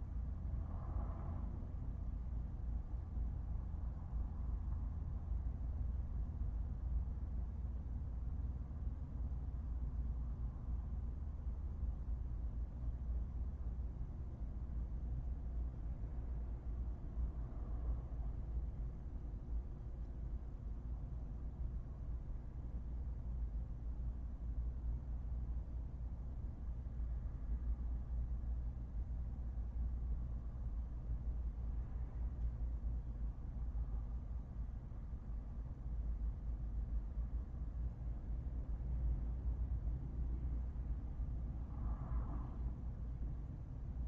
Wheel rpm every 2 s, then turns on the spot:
0, 0, 0, 0, 0, 0, 0, 0, 0, 0, 0, 0, 0, 0, 0, 0, 0, 0, 0, 0, 0, 0.
none